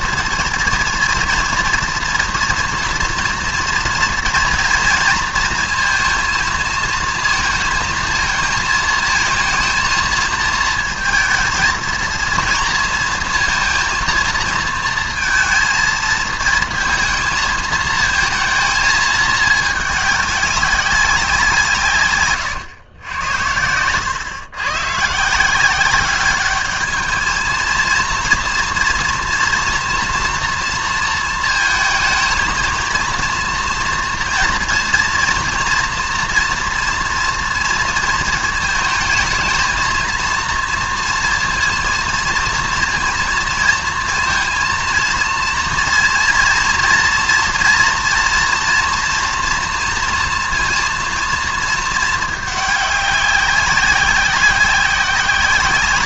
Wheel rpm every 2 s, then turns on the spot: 230, 230, 230, 230, 220, 220, 230, 230, 220, 220, 200, 110, 130, 210, 230, 230, 230, 230, 230, 220, 230, 230, 230, 230, 240, 230, 200, 190.
none